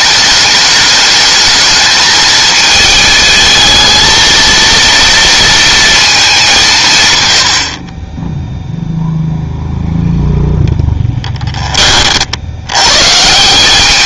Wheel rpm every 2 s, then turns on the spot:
210, 220, 230, 140, 0, 10, 120.
10-12